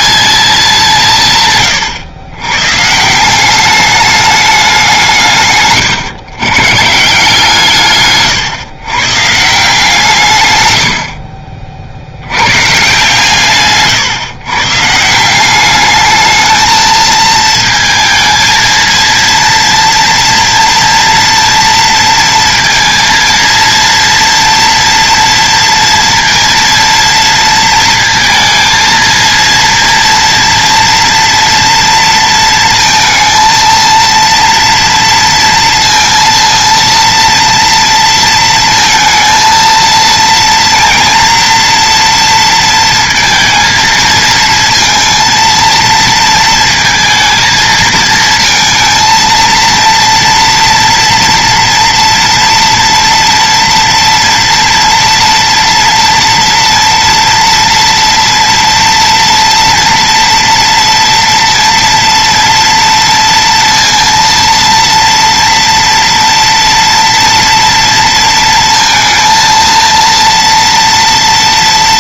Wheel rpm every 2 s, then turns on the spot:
190, 130, 190, 140, 130, 110, 120, 140, 220, 230, 240, 230, 230, 230, 220, 230, 230, 230, 230, 230, 230, 230, 230, 230, 220, 230, 230, 230, 230, 230, 230, 230, 230, 230, 230, 230.
none